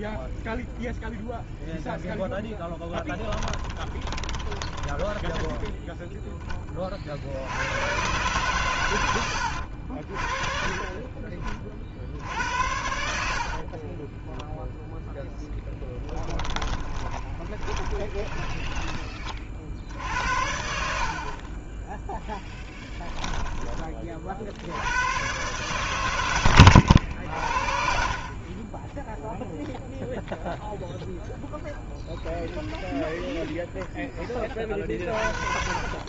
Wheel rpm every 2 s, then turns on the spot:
0, 10, 20, 20, 110, 40, 70, 0, 20, 20, 60, 10, 60, 100, 40, 0, 0, 20.
2-6 16-20 22-24 26-28